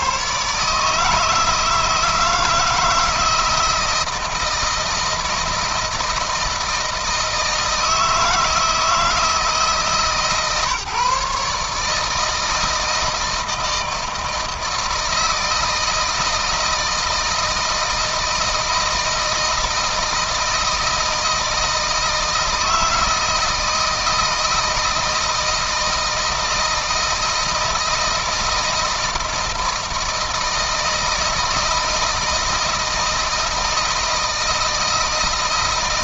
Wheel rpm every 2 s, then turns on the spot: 140, 160, 160, 160, 160, 140, 160, 160, 160, 160, 160, 160, 160, 160, 170, 160, 160, 160.
none